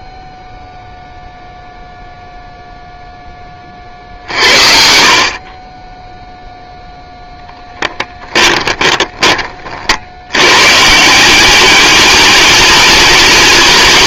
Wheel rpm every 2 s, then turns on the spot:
20, 0, 60, 0, 20, 140, 210.
8-10